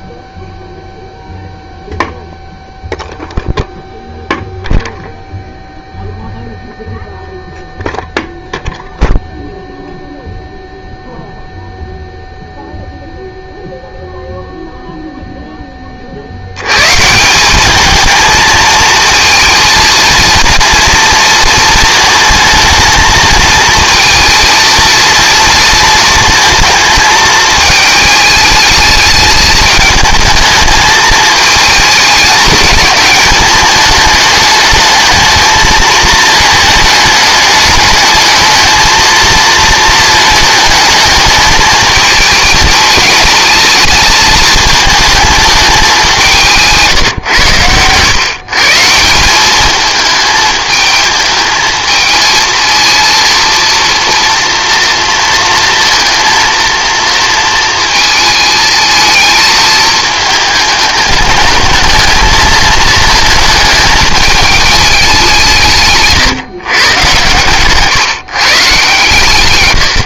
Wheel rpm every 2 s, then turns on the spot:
0, 0, 0, 0, 0, 0, 0, 0, 120, 220, 230, 220, 230, 220, 210, 220, 210, 210, 210, 220, 210, 220, 220, 160, 170, 220, 230, 230, 230, 220, 210, 220, 210, 120, 130.
none